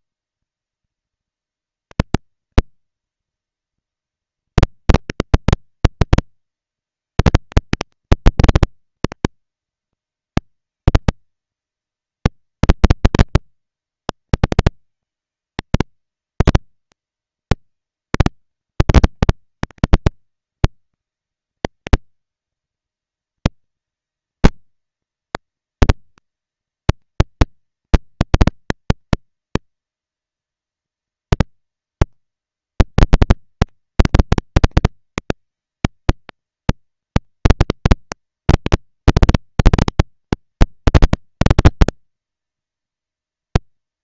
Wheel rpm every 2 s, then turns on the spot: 230, 230, 230, 230, 230, 230, 230, 230, 230, 220, 190, 210, 230, 230, 230, 230, 230, 230, 230, 240, 220, 230.
none